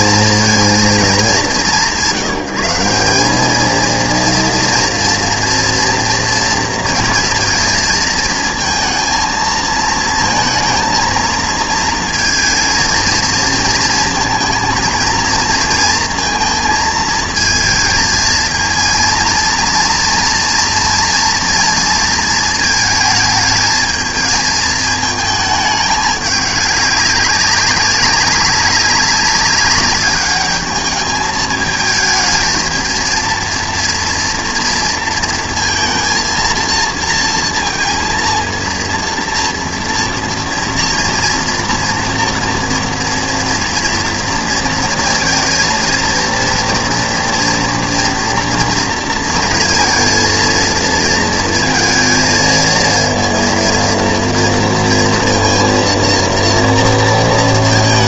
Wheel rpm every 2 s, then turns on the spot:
230, 180, 230, 230, 230, 220, 230, 230, 230, 230, 240, 220, 220, 200, 200, 210, 220, 230, 230, 230, 230, 230, 230, 230, 230, 230, 230, 230, 230.
none